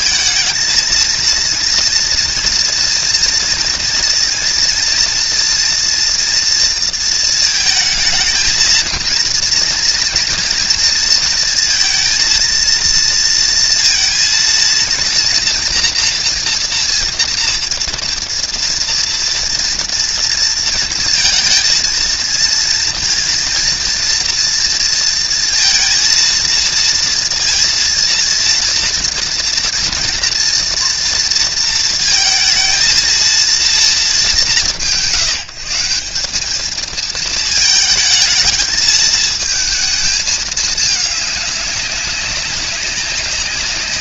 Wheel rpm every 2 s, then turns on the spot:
220, 230, 230, 230, 230, 230, 230, 230, 240, 230, 230, 230, 230, 230, 240, 230, 220, 170, 210, 220, 220, 190.
none